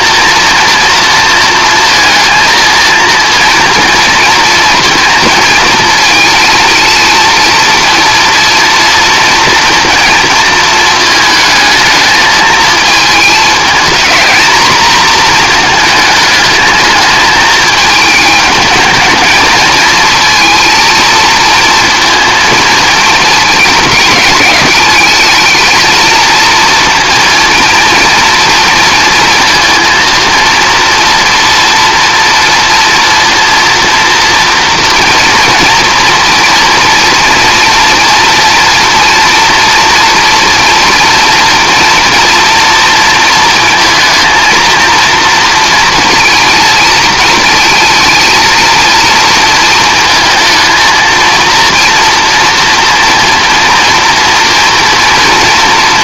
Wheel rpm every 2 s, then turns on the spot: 230, 230, 230, 230, 230, 220, 220, 230, 220, 220, 230, 230, 210, 230, 230, 230, 230, 230, 230, 230, 230, 230, 230, 230, 230, 230, 230, 240.
none